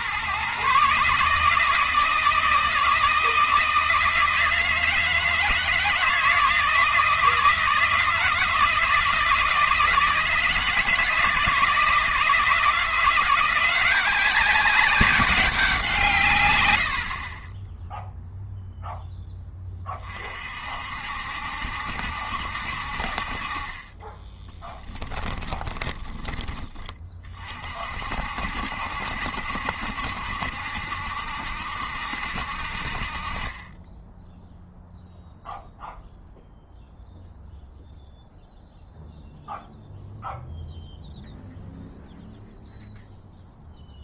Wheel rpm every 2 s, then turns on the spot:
140, 160, 160, 160, 160, 160, 160, 200, 110, 0, 50, 60, 10, 30, 60, 70, 60, 0, 0, 0, 0, 0.
24-26